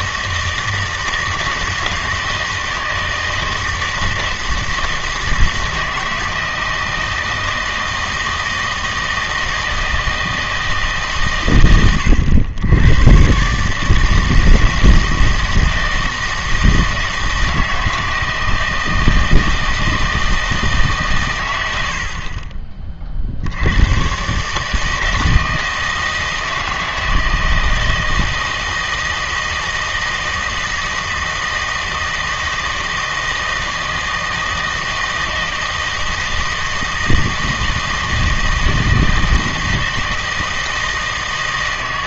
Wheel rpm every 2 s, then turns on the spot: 160, 160, 160, 160, 160, 160, 110, 160, 160, 160, 160, 30, 150, 160, 160, 160, 160, 160, 160, 160, 160.
none